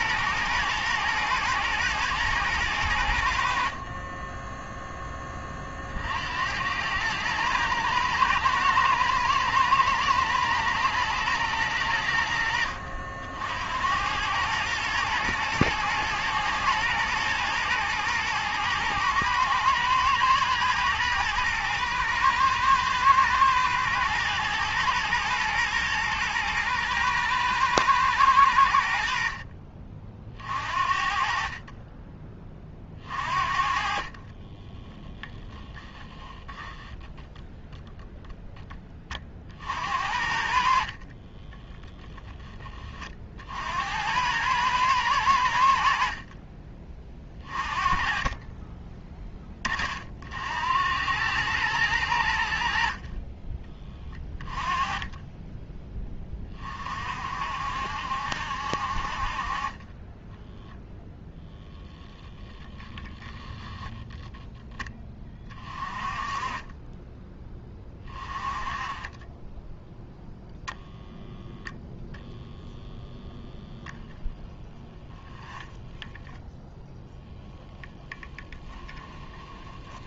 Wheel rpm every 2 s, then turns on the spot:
120, 90, 10, 100, 110, 110, 70, 110, 120, 110, 120, 110, 110, 110, 70, 50, 40, 10, 10, 20, 40, 30, 100, 30, 20, 90, 60, 20, 50, 50, 0, 0, 10, 20, 20, 0, 0, 20, 0, 10.
32-38 40-42 74-76 78-80